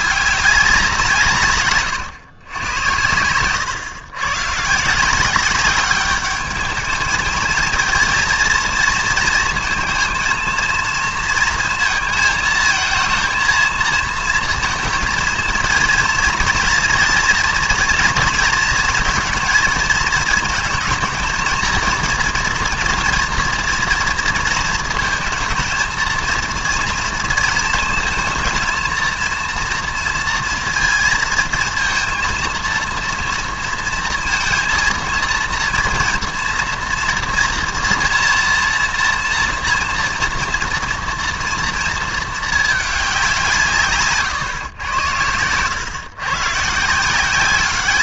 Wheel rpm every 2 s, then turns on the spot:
190, 100, 130, 210, 230, 230, 220, 230, 240, 230, 220, 230, 230, 230, 220, 230, 230, 230, 230, 230, 230, 220, 130, 140.
none